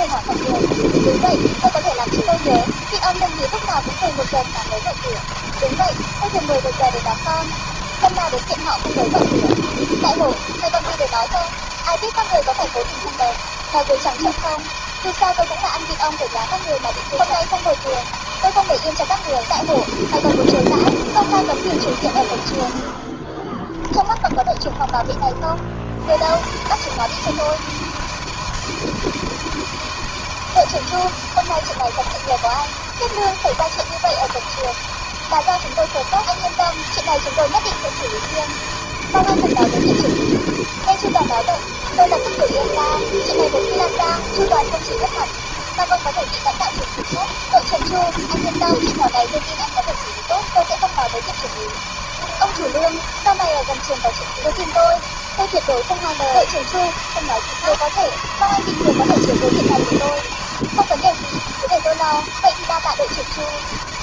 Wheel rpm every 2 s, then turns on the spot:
160, 160, 160, 160, 160, 160, 160, 160, 160, 160, 160, 100, 20, 100, 160, 160, 160, 160, 160, 160, 160, 160, 160, 160, 160, 160, 160, 160, 160, 160, 160, 160.
24-26